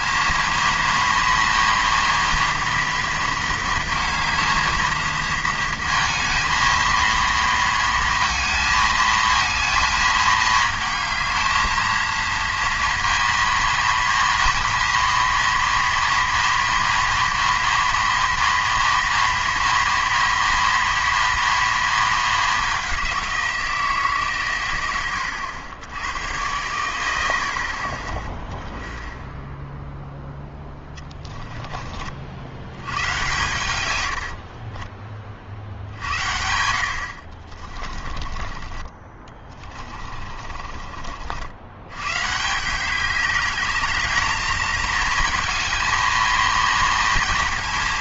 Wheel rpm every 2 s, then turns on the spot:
230, 240, 220, 230, 230, 220, 230, 230, 230, 230, 230, 190, 110, 100, 10, 10, 100, 40, 80, 30, 40, 170, 220, 230.
30-32 34-42